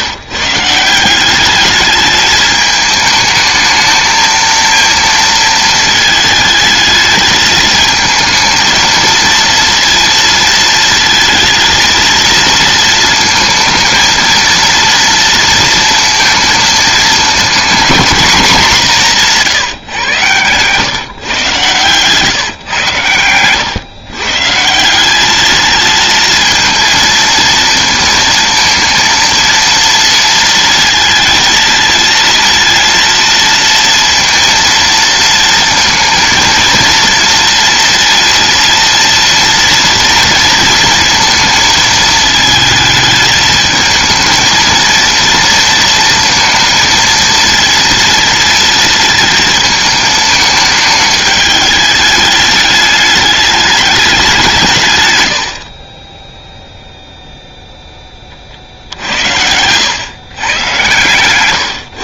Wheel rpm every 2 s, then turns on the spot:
160, 210, 230, 220, 220, 230, 230, 230, 220, 210, 130, 130, 150, 220, 230, 230, 230, 230, 230, 230, 230, 220, 220, 230, 230, 220, 210, 160, 0, 50, 130.
58-60